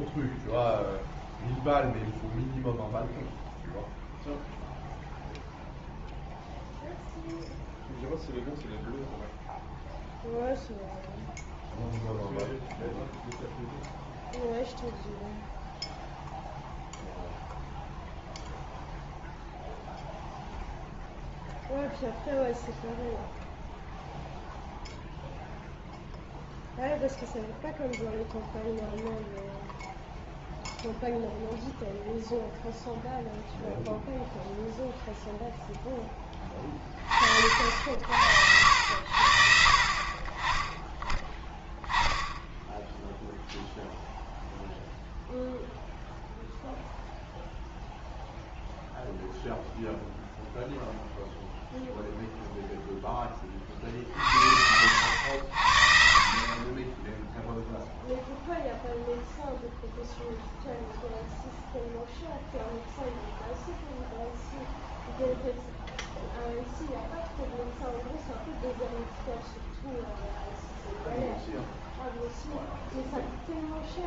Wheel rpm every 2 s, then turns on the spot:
0, 0, 0, 0, 0, 0, 0, 0, 0, 0, 0, 0, 0, 0, 0, 0, 0, 0, 30, 80, 20, 0, 0, 0, 0, 0, 0, 70, 40, 0, 0, 0, 0, 0, 0, 0, 0.
none